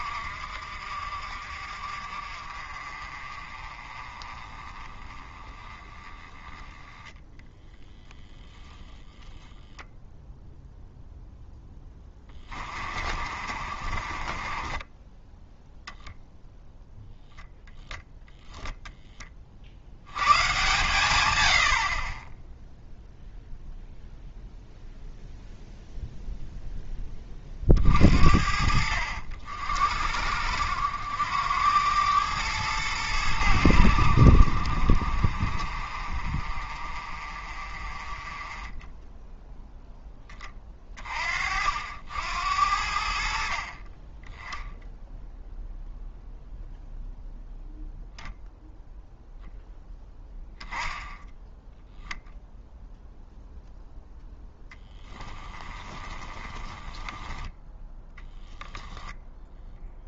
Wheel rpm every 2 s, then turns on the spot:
50, 40, 20, 10, 0, 0, 30, 30, 0, 0, 120, 0, 0, 10, 60, 80, 100, 60, 40, 10, 30, 70, 0, 0, 0, 0, 0, 10, 10, 0.
12-16 54-58